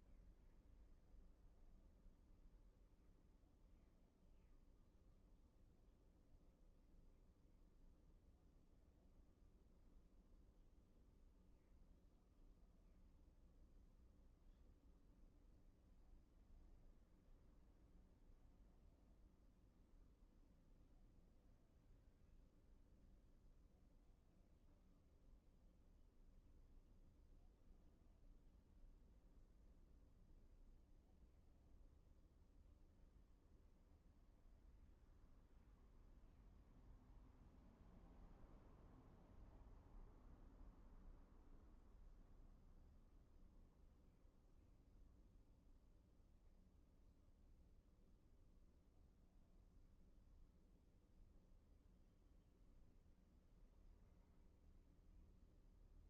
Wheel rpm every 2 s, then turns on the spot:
0, 0, 0, 0, 0, 0, 0, 0, 0, 0, 0, 0, 0, 0, 0, 0, 0, 0, 0, 0, 0, 0, 0, 0, 0, 0, 0, 0.
none